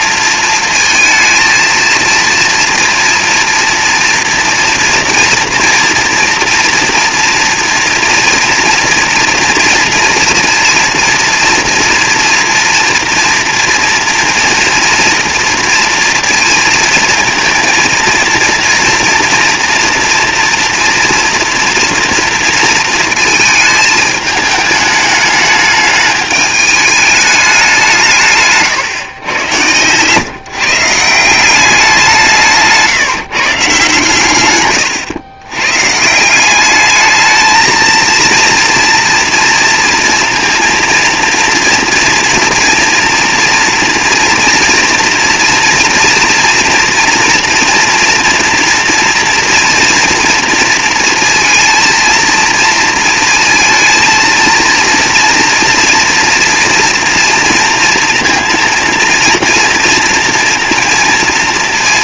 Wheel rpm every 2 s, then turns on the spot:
230, 230, 230, 230, 230, 230, 230, 240, 230, 230, 230, 230, 210, 210, 150, 150, 150, 110, 190, 230, 230, 240, 230, 230, 230, 230, 230, 230, 230, 230, 230.
28-30